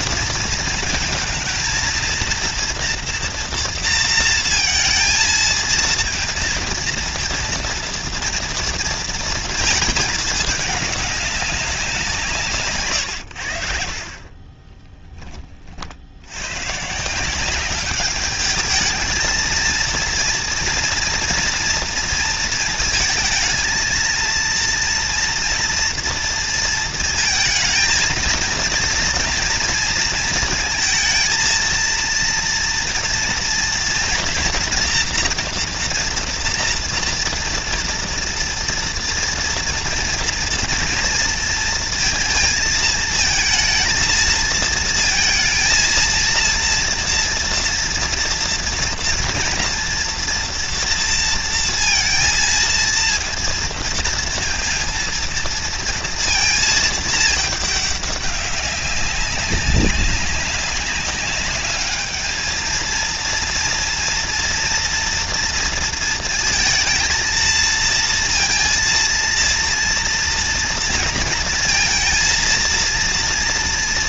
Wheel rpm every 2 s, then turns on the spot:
220, 230, 230, 230, 230, 200, 120, 10, 160, 220, 230, 220, 230, 230, 230, 220, 230, 230, 230, 230, 230, 220, 230, 230, 230, 230, 230, 230, 220, 200, 190, 230, 230, 220, 230, 230, 230.
none